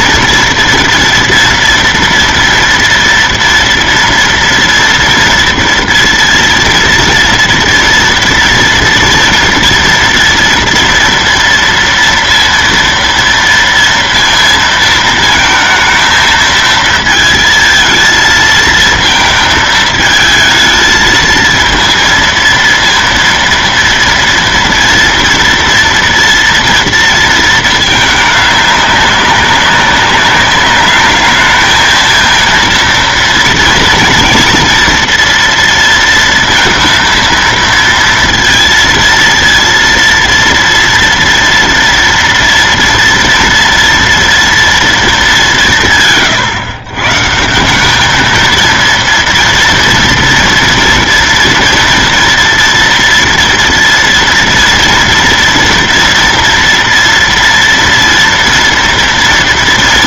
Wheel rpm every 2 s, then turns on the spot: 230, 230, 230, 230, 230, 240, 230, 230, 220, 220, 220, 230, 230, 240, 210, 200, 230, 230, 230, 230, 230, 240, 230, 120, 220, 230, 230, 230, 240, 230.
none